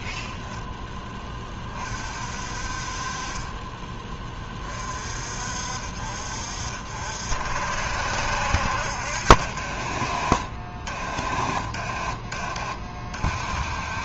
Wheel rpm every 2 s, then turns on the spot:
0, 40, 20, 50, 60, 40, 40.
none